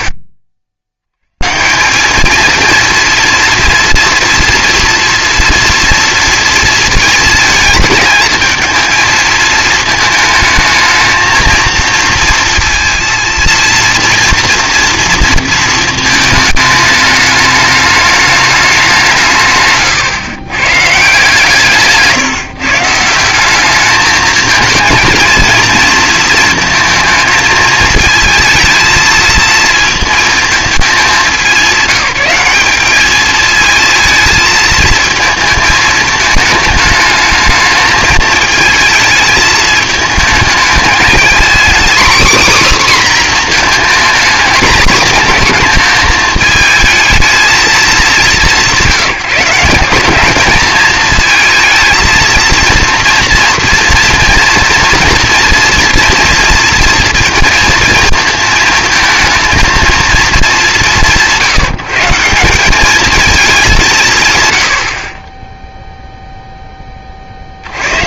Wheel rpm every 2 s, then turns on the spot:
70, 230, 230, 230, 220, 220, 230, 230, 220, 190, 140, 150, 230, 230, 230, 220, 200, 220, 210, 220, 220, 270, 220, 220, 190, 220, 230, 230, 230, 230, 200, 200, 100, 10.
none